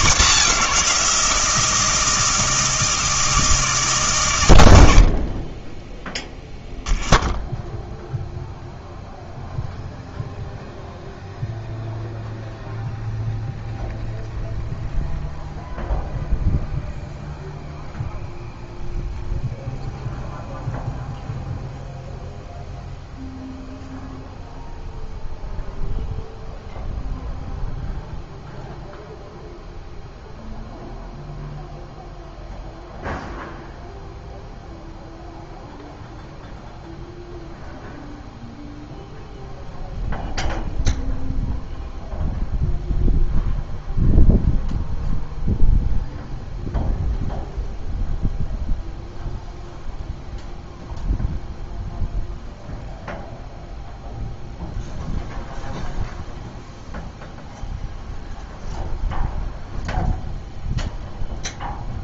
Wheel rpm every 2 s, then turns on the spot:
180, 160, 110, 10, 0, 0, 0, 0, 0, 0, 0, 0, 0, 0, 0, 0, 0, 0, 0, 0, 0, 0, 0, 0, 0, 0, 0, 0, 0, 0, 0.
none